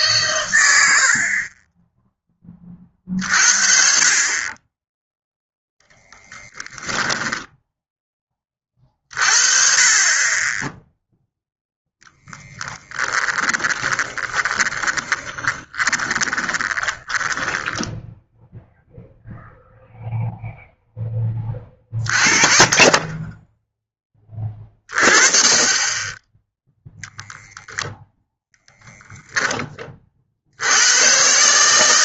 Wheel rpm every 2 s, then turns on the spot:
70, 40, 10, 10, 40, 0, 10, 20, 20, 0, 10, 20, 30, 0, 0, 100.
6-8 12-18